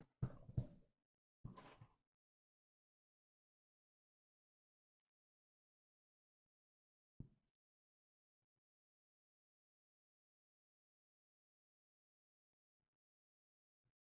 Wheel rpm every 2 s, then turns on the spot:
0, 0, 0, 0, 0, 0, 0.
none